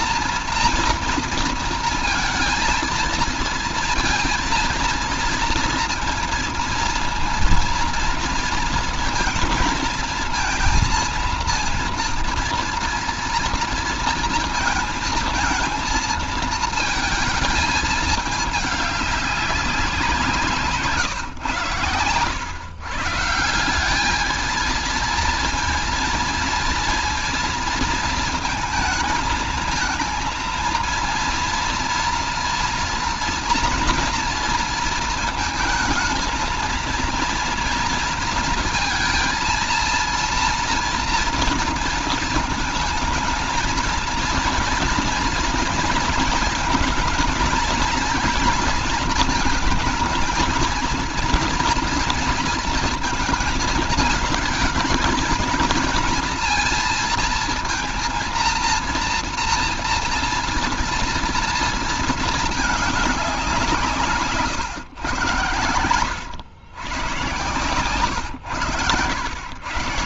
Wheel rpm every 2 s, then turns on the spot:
230, 230, 230, 230, 230, 230, 230, 230, 220, 210, 160, 110, 220, 230, 230, 230, 230, 230, 230, 230, 230, 230, 230, 230, 230, 230, 230, 220, 230, 230, 230, 220, 140, 120, 120.
none